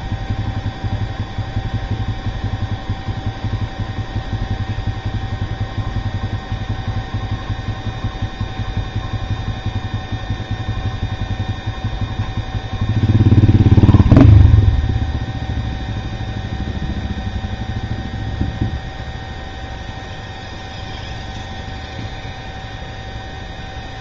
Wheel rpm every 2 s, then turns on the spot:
0, 0, 0, 0, 0, 0, 0, 0, 0, 0, 0, 0.
none